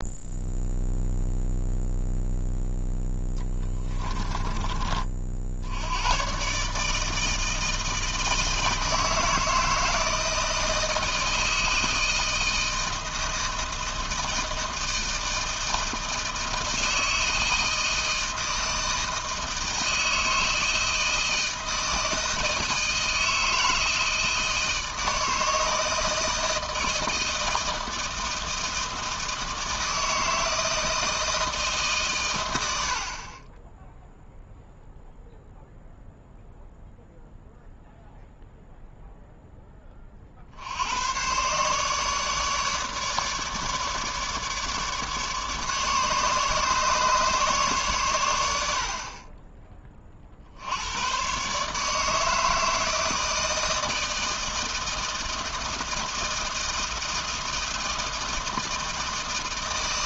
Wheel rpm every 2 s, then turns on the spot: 0, 0, 30, 150, 160, 160, 160, 160, 160, 160, 160, 160, 160, 160, 160, 160, 80, 0, 0, 0, 80, 150, 150, 150, 70, 90, 160, 160, 160, 160.
none